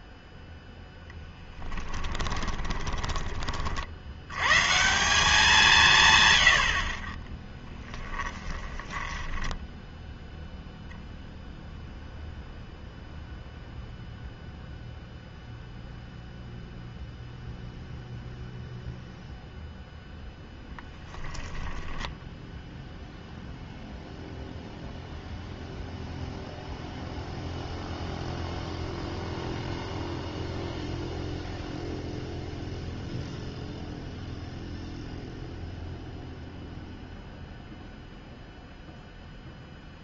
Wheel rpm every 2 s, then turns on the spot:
0, 20, 130, 60, 10, 0, 0, 0, 0, 0, 10, 0, 0, 0, 0, 0, 0, 0, 0, 0.
2-4 8-10